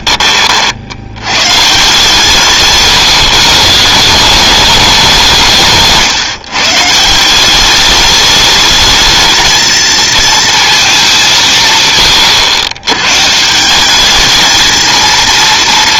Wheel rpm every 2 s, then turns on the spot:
60, 160, 200, 150, 210, 220, 120, 230.
none